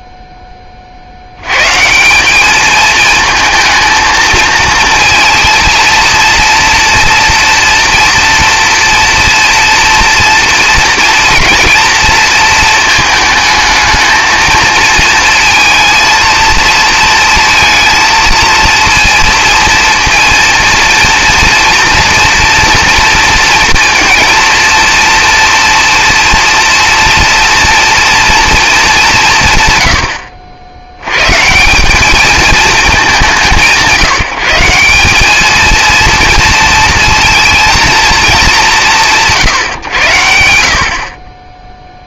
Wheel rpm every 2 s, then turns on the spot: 20, 210, 230, 230, 230, 230, 220, 220, 220, 230, 230, 230, 230, 230, 220, 70, 210, 160, 230, 180, 60.
30-32